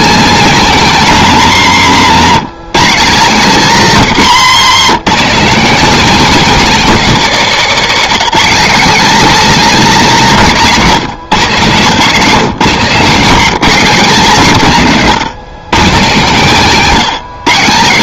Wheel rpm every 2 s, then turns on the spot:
250, 190, 190, 250, 220, 190, 170, 180, 180.
none